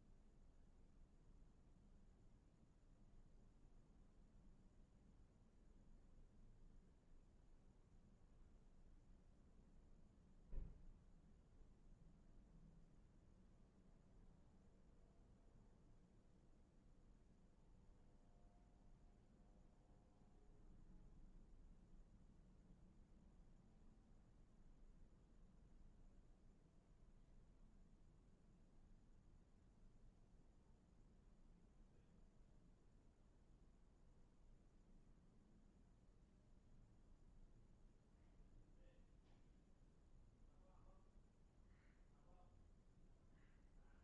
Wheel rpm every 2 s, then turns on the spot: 0, 0, 0, 0, 0, 0, 0, 0, 0, 0, 0, 0, 0, 0, 0, 0, 0, 0, 0, 0, 0, 0.
none